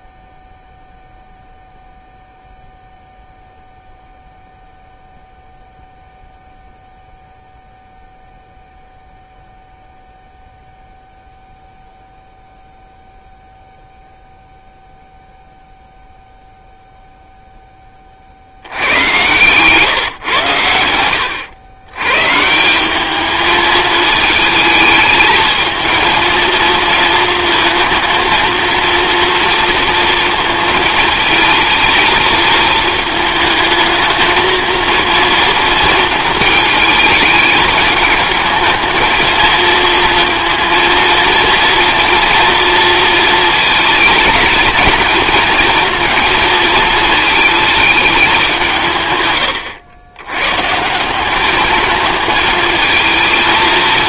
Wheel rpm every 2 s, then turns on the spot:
0, 0, 0, 0, 0, 0, 0, 0, 0, 90, 100, 180, 220, 230, 230, 230, 220, 230, 220, 220, 230, 230, 220, 220, 160, 150, 220.
none